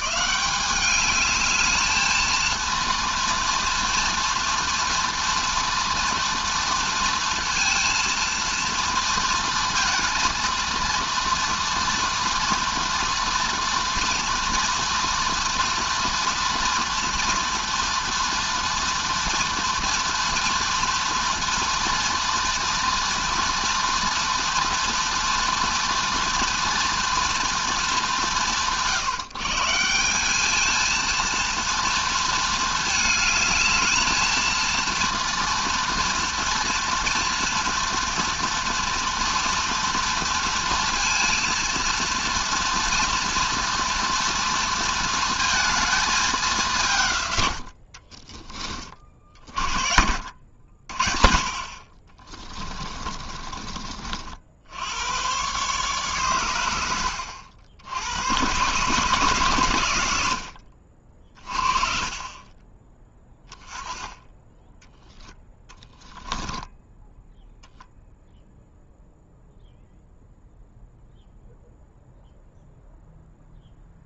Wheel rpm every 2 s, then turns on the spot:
200, 230, 230, 230, 230, 230, 230, 240, 230, 230, 230, 230, 230, 230, 130, 220, 220, 230, 230, 240, 230, 240, 220, 160, 30, 60, 20, 80, 90, 130, 50, 20, 10, 10, 0, 0, 0.
52-54